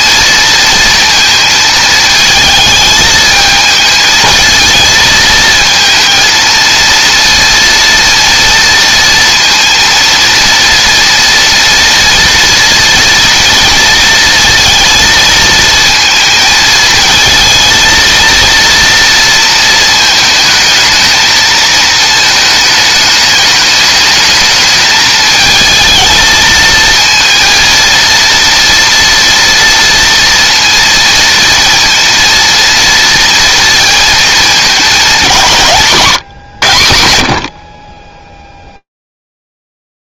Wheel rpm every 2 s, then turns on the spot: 230, 220, 230, 230, 230, 230, 230, 230, 220, 230, 220, 220, 210, 220, 230, 230, 230, 210, 110, 0.
none